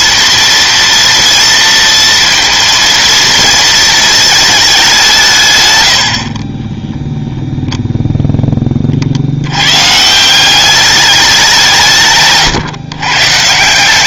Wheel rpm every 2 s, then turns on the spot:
230, 230, 210, 10, 30, 200, 130.
6-8